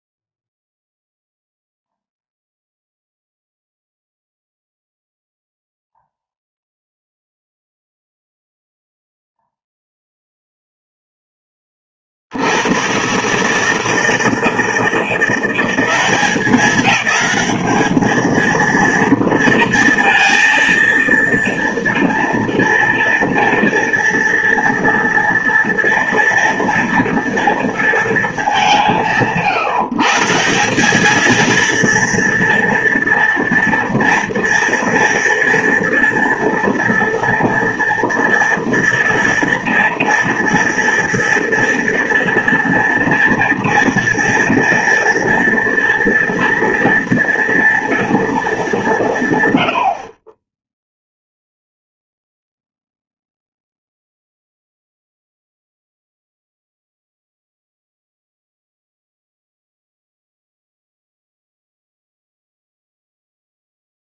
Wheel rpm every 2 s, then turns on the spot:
0, 0, 0, 0, 0, 0, 90, 170, 200, 230, 230, 230, 230, 230, 190, 190, 230, 230, 230, 230, 230, 230, 230, 230, 200, 10, 0, 0, 0, 0, 0, 0.
none